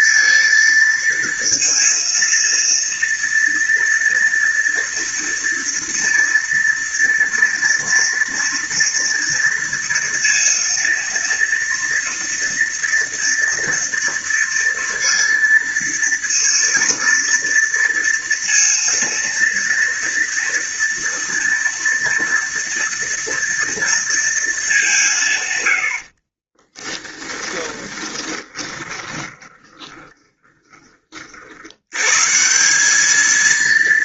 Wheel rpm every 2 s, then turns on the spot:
230, 230, 230, 230, 230, 230, 230, 230, 230, 230, 230, 230, 160, 10, 20, 40, 210.
26-30